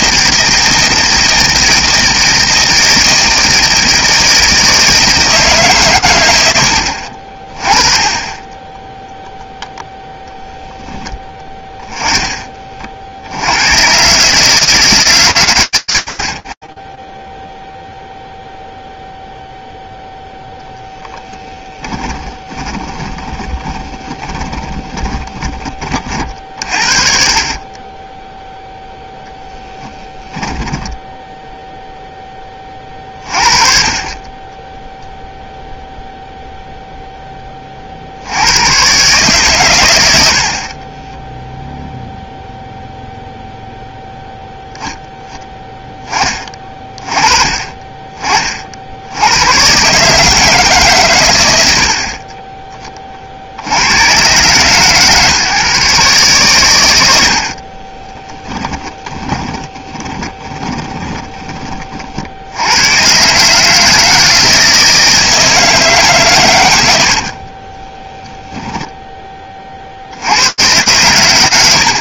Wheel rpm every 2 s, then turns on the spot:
160, 160, 160, 90, 10, 0, 30, 150, 30, 0, 10, 20, 20, 40, 0, 10, 30, 0, 0, 110, 30, 0, 0, 20, 60, 140, 20, 130, 100, 10, 20, 90, 160, 110, 10, 120.
22-26 40-42 58-62 68-70